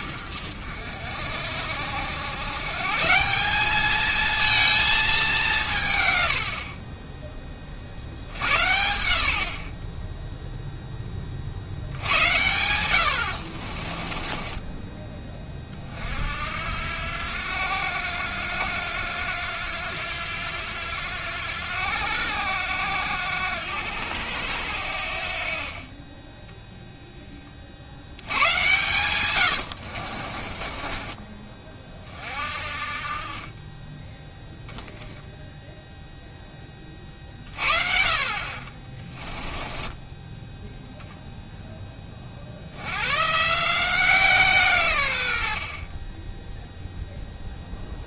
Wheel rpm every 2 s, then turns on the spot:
60, 130, 220, 60, 90, 0, 90, 20, 70, 90, 90, 90, 80, 0, 110, 30, 40, 0, 20, 30, 0, 80, 140, 0.
14-16 30-32